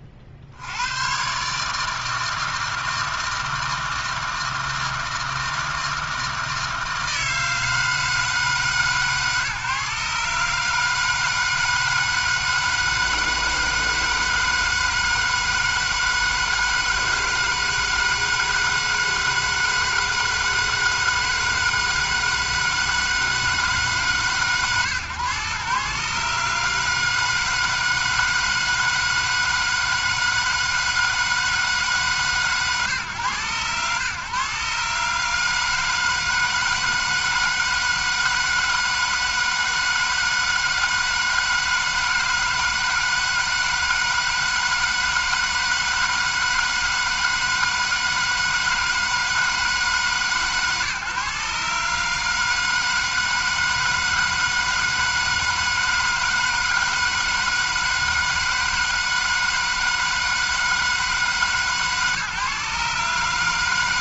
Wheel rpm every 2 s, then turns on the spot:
70, 160, 160, 160, 150, 150, 160, 160, 160, 160, 160, 160, 130, 150, 160, 160, 130, 140, 160, 160, 160, 160, 160, 160, 160, 140, 160, 160, 160, 160, 160, 150.
none